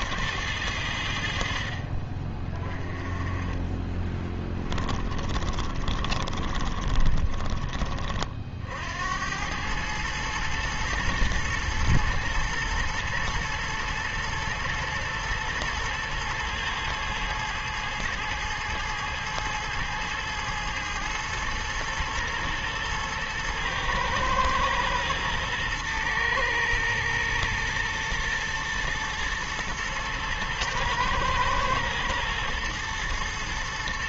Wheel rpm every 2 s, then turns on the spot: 90, 20, 20, 20, 60, 110, 120, 120, 110, 110, 110, 110, 110, 110, 110, 110, 110.
4-8